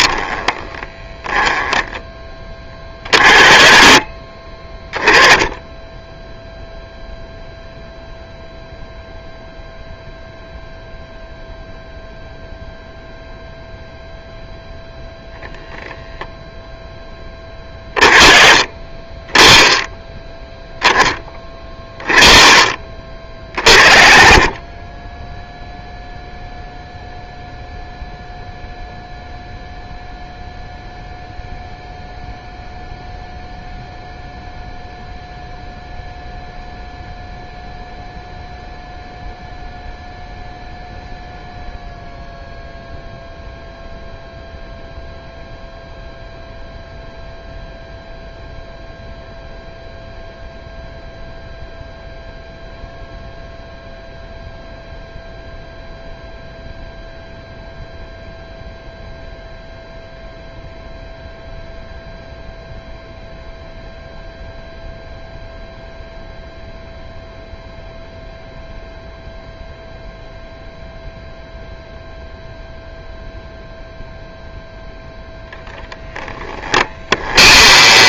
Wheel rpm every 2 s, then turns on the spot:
10, 20, 10, 0, 0, 0, 0, 0, 10, 20, 10, 30, 20, 0, 0, 0, 0, 0, 0, 0, 0, 0, 0, 0, 0, 0, 0, 0, 0, 0, 0, 0, 0, 0, 0, 0, 0, 0, 20.
76-78